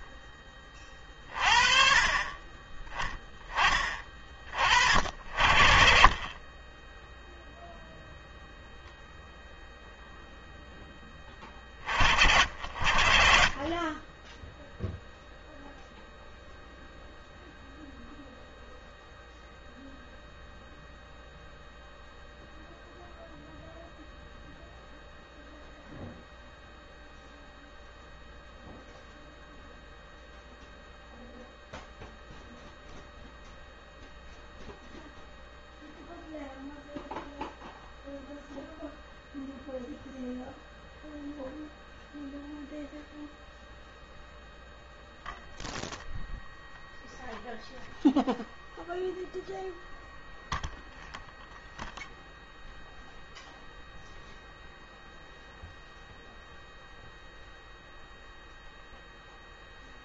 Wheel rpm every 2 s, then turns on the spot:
30, 40, 20, 0, 10, 50, 0, 0, 0, 0, 0, 0, 0, 0, 0, 0, 0, 0, 0, 0, 0, 0, 0, 0, 0, 0, 0, 0, 0, 0.
none